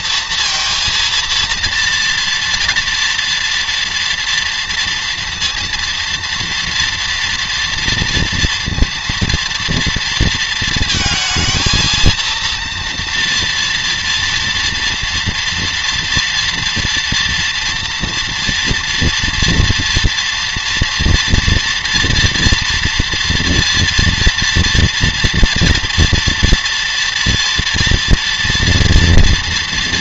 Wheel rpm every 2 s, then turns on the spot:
230, 230, 230, 230, 230, 220, 230, 230, 230, 240, 240, 240, 230, 230, 230.
none